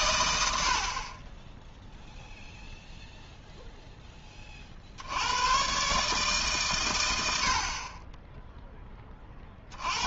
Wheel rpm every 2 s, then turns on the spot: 70, 0, 40, 130, 10.
none